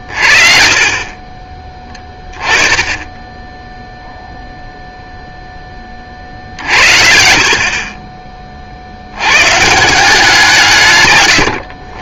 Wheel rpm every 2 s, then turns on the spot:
30, 20, 0, 60, 40, 170.
2-4